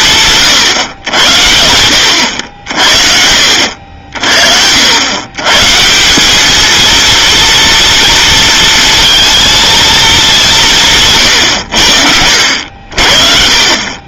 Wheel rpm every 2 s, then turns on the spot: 140, 70, 60, 210, 230, 190, 80.
none